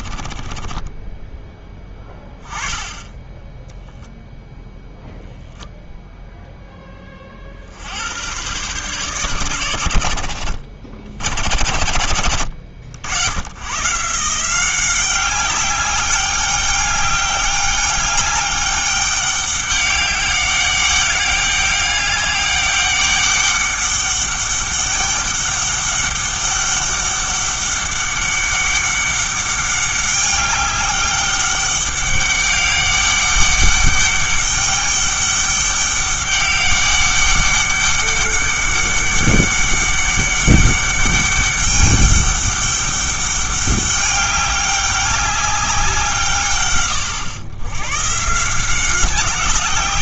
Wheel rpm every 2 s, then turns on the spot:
20, 10, 0, 10, 110, 80, 70, 180, 200, 200, 200, 200, 200, 200, 200, 200, 200, 200, 200, 200, 200, 200, 200, 120, 180.
0-2